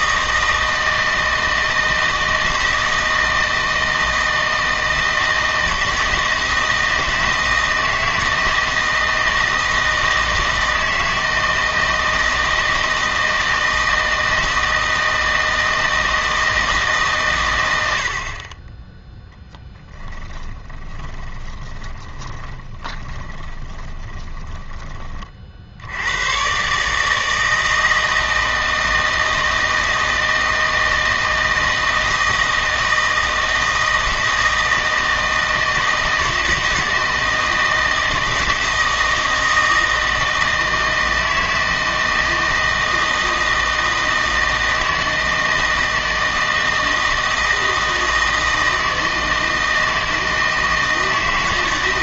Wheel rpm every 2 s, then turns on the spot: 160, 160, 160, 160, 160, 160, 160, 160, 150, 20, 20, 20, 20, 140, 160, 160, 160, 160, 160, 160, 160, 160, 160, 160, 160, 160.
20-26